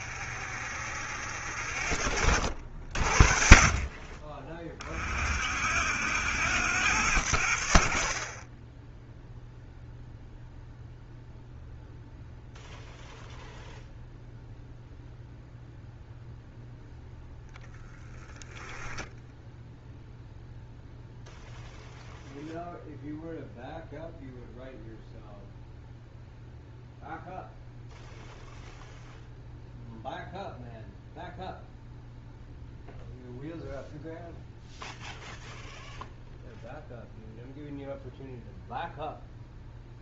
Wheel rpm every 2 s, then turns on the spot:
60, 70, 40, 90, 10, 0, 0, 0, 0, 0, 0, 0, 0, 0, 0, 0, 0, 0, 0, 0.
none